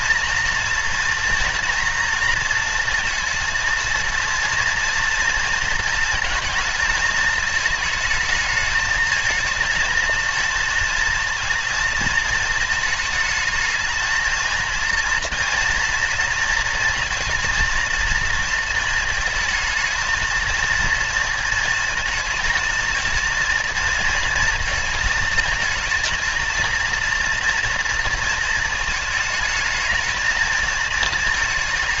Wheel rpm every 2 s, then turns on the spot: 230, 230, 230, 220, 220, 230, 220, 230, 230, 220, 220, 220, 230, 230, 230, 230.
none